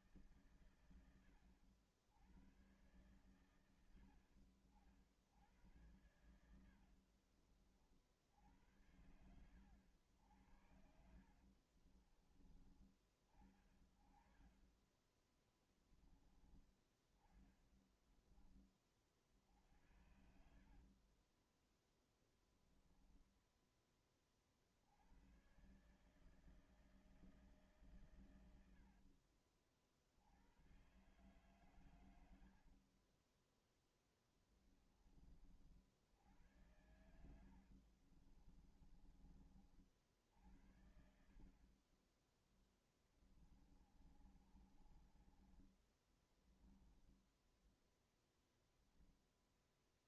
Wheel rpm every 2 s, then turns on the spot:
110, 100, 60, 100, 70, 80, 40, 20, 10, 20, 60, 20, 40, 150, 100, 80, 80, 10, 80, 40, 60, 20, 40, 10, 0.
6-8 10-12 14-16 22-24 28-30 32-34 36-40 42-48